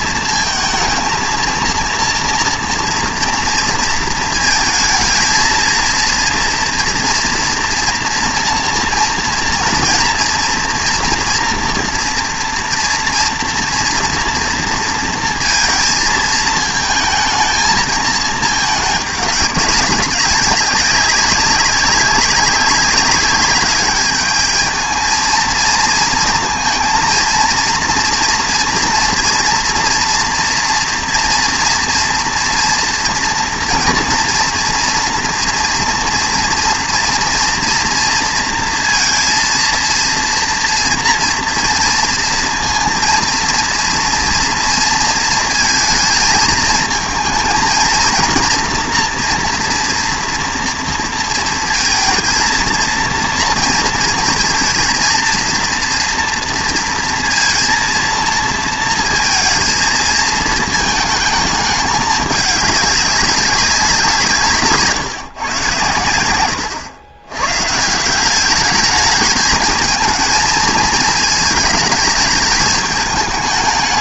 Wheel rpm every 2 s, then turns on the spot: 220, 230, 220, 230, 230, 240, 230, 230, 220, 220, 200, 200, 220, 230, 230, 230, 230, 230, 230, 230, 230, 230, 230, 220, 230, 230, 230, 230, 230, 230, 220, 210, 150, 100, 210, 220, 210.
none